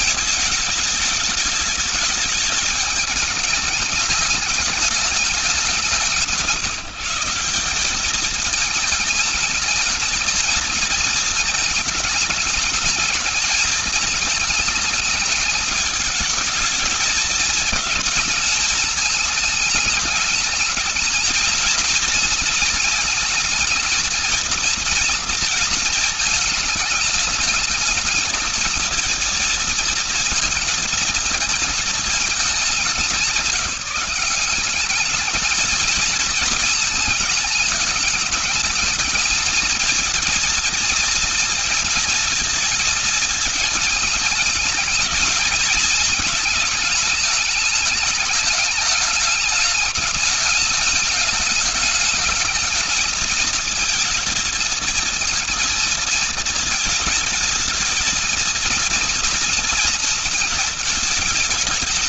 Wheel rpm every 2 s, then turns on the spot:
220, 210, 210, 150, 220, 230, 230, 220, 210, 220, 210, 220, 220, 220, 220, 230, 210, 190, 220, 220, 220, 220, 220, 220, 210, 210, 210, 220, 220, 230, 230.
none